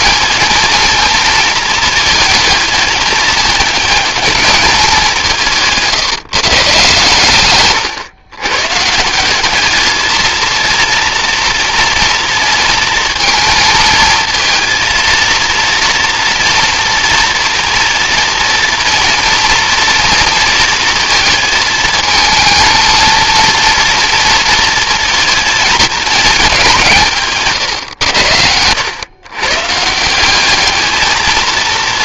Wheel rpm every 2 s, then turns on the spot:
230, 220, 200, 150, 140, 230, 230, 230, 230, 240, 230, 230, 230, 180, 100, 210.
none